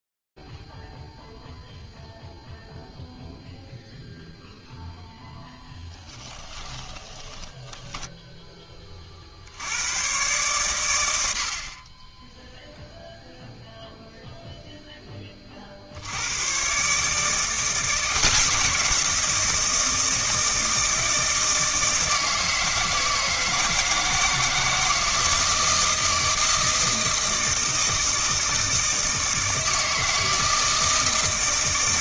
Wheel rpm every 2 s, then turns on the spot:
0, 0, 0, 10, 20, 110, 0, 0, 120, 170, 160, 160, 160, 160, 160, 160.
6-8